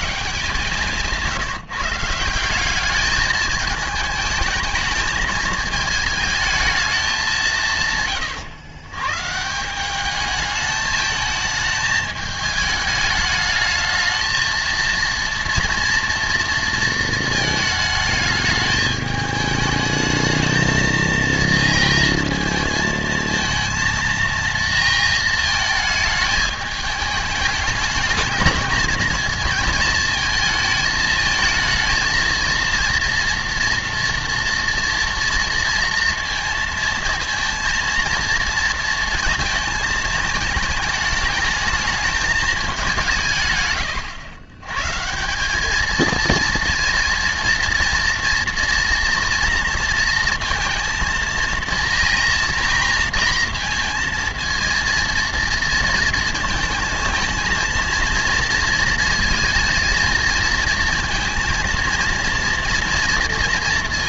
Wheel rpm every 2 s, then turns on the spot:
170, 210, 220, 190, 140, 220, 210, 230, 220, 210, 230, 220, 220, 210, 230, 220, 240, 230, 230, 230, 220, 160, 160, 230, 230, 230, 230, 230, 220, 230, 230, 230.
none